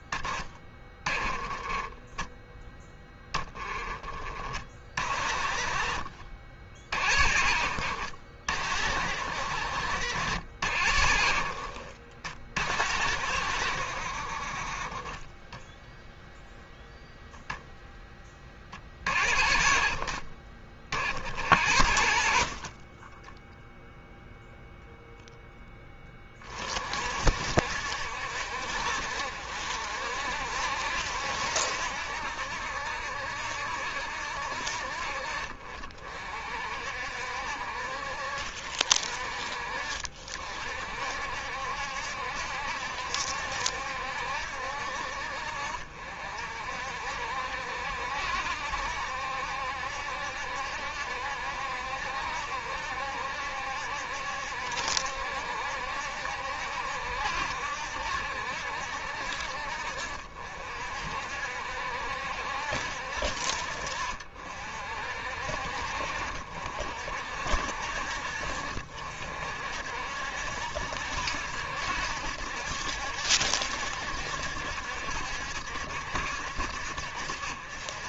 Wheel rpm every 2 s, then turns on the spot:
20, 10, 40, 50, 60, 60, 60, 30, 0, 30, 50, 30, 0, 30, 60, 70, 70, 60, 50, 50, 60, 70, 60, 60, 70, 70, 70, 70, 70, 70, 50, 60, 50, 60, 60, 70, 70, 70, 60.
none